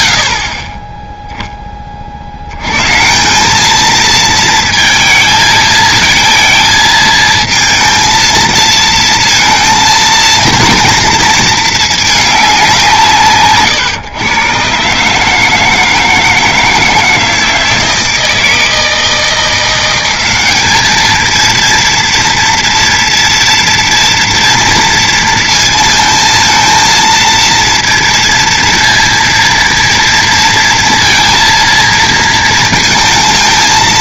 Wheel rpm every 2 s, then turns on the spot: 10, 200, 220, 220, 230, 230, 140, 160, 160, 170, 220, 230, 230, 230, 230, 230, 230.
none